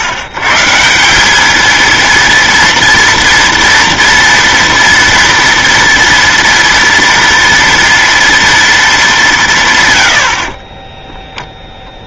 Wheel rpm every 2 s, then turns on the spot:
140, 230, 230, 230, 230, 30.
10-12